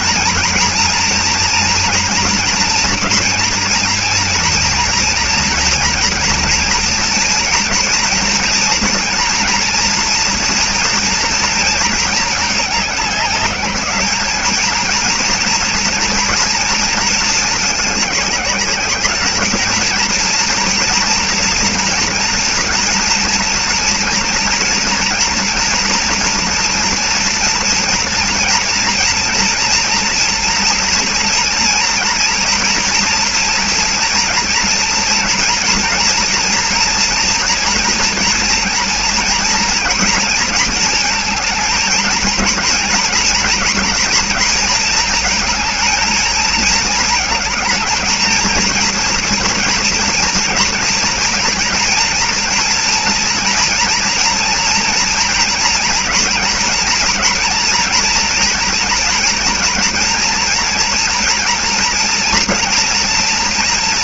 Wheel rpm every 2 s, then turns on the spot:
240, 240, 240, 230, 240, 240, 210, 220, 230, 200, 240, 230, 230, 230, 230, 240, 240, 230, 240, 230, 230, 230, 230, 220, 230, 230, 230, 240, 230, 230, 240, 230.
none